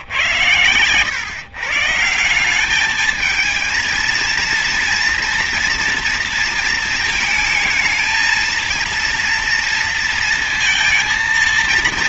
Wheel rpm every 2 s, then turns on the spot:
120, 190, 230, 230, 220, 230.
none